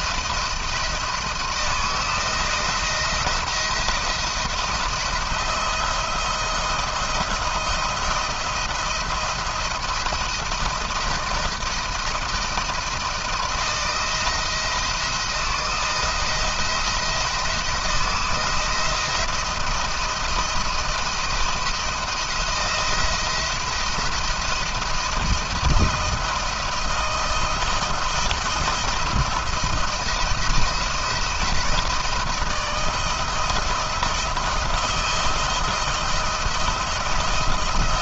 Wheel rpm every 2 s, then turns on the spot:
170, 170, 170, 170, 170, 170, 160, 160, 160, 170, 170, 160, 170, 160, 170, 170, 160, 160, 170.
none